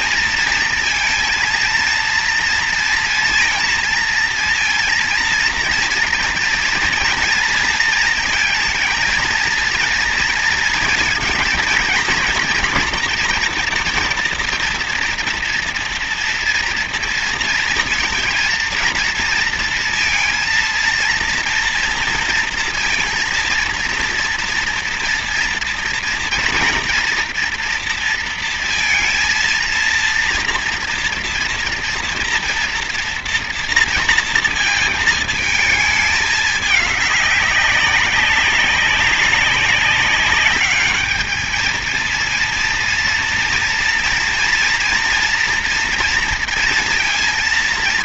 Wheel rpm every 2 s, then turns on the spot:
230, 230, 230, 230, 230, 230, 240, 230, 230, 230, 230, 230, 230, 240, 230, 230, 230, 230, 210, 190, 210, 230, 230, 230.
none